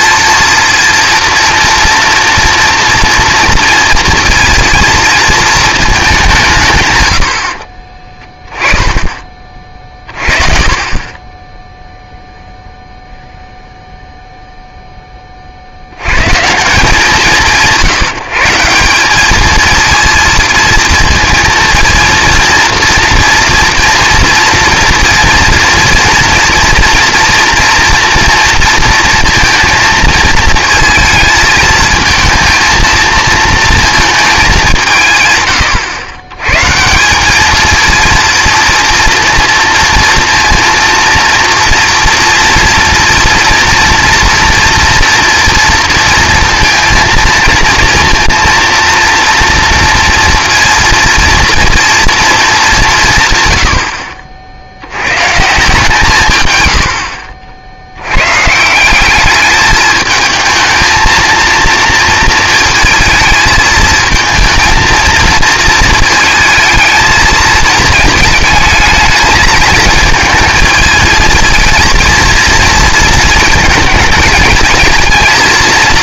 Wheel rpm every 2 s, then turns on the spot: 230, 230, 230, 140, 10, 30, 0, 0, 160, 170, 230, 230, 230, 230, 230, 220, 230, 190, 140, 230, 230, 230, 230, 230, 230, 230, 200, 80, 110, 160, 220, 220, 220, 220, 220, 220, 230, 220.
none